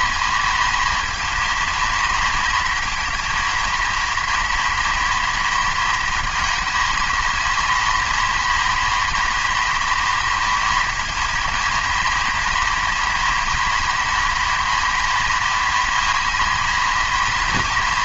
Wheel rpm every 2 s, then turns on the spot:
230, 230, 230, 230, 230, 230, 240, 230, 230.
none